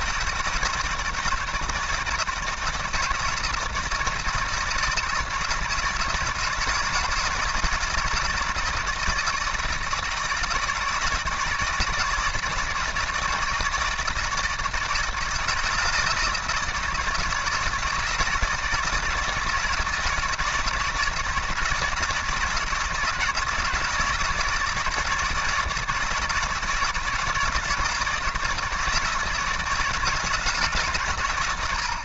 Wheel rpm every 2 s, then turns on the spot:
160, 160, 160, 160, 160, 160, 160, 160, 160, 160, 160, 160, 160, 160, 160, 130.
none